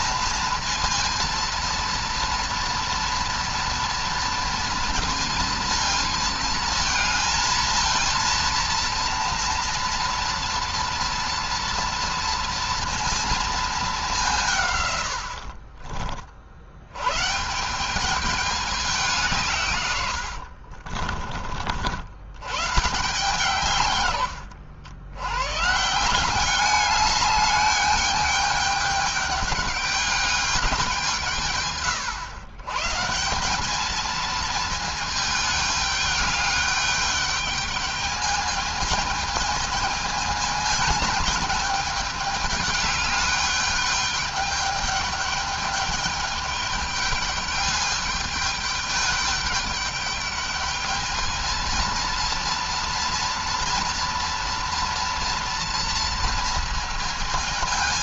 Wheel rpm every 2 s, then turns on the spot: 230, 230, 230, 220, 230, 230, 230, 140, 100, 200, 50, 120, 90, 200, 210, 190, 130, 220, 210, 210, 220, 210, 210, 210, 210, 210, 230, 230, 230.
20-22